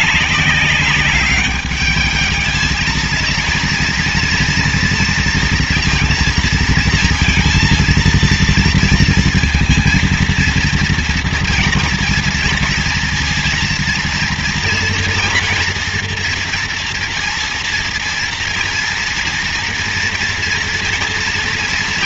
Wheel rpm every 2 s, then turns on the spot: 200, 220, 230, 230, 230, 230, 230, 240, 230, 230, 230.
none